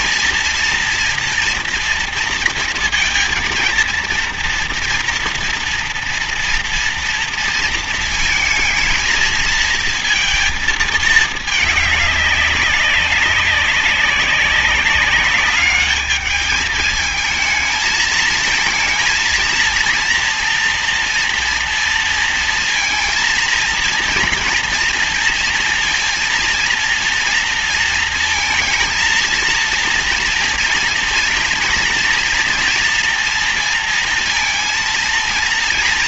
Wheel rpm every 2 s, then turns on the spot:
230, 230, 230, 230, 220, 220, 190, 200, 220, 220, 230, 230, 230, 230, 230, 230, 230, 230.
none